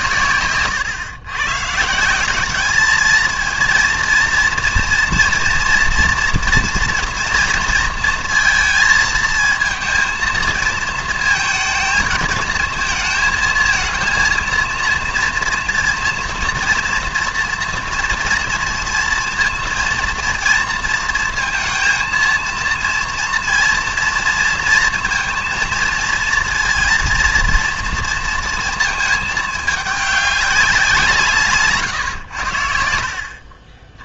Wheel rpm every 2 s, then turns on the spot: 120, 210, 230, 230, 230, 230, 230, 230, 230, 240, 230, 230, 230, 230, 230, 190, 80.
none